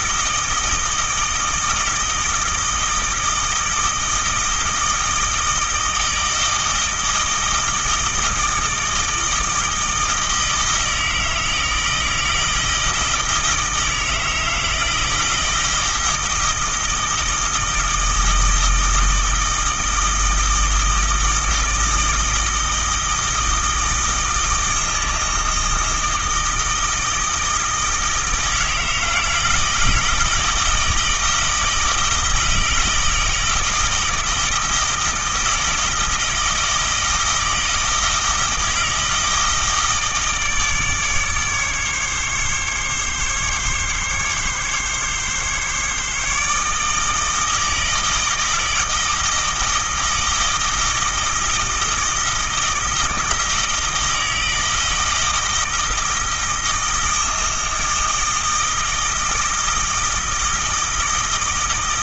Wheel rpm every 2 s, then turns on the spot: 160, 160, 160, 160, 160, 160, 160, 160, 160, 160, 160, 160, 160, 160, 160, 160, 160, 160, 160, 160, 150, 140, 140, 150, 160, 160, 160, 160, 160, 160, 160.
none